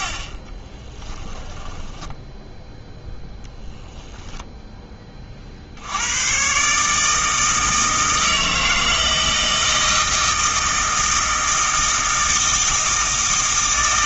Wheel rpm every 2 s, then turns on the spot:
20, 10, 10, 140, 160, 160, 160.
0-2